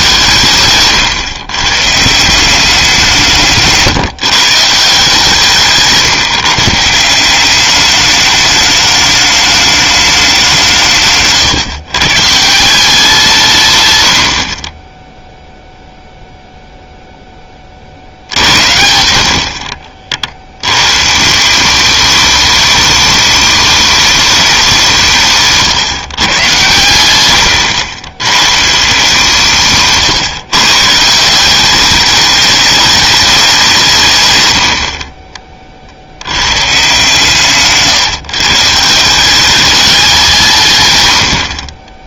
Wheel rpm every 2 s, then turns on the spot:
140, 180, 150, 150, 210, 170, 170, 20, 0, 70, 110, 210, 190, 110, 160, 150, 210, 90, 130, 160, 140.
0-2